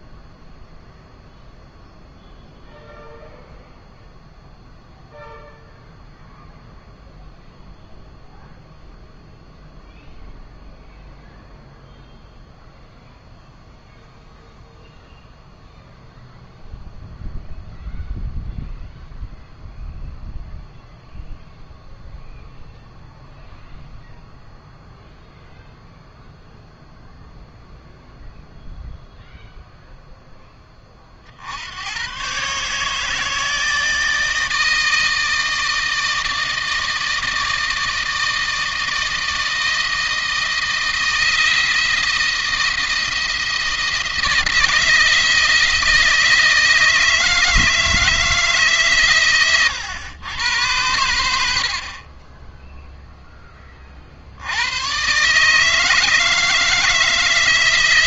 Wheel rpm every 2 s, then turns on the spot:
0, 0, 0, 0, 0, 0, 0, 0, 0, 0, 0, 0, 0, 0, 0, 30, 140, 160, 160, 160, 160, 160, 160, 160, 130, 110, 10, 120, 160.
none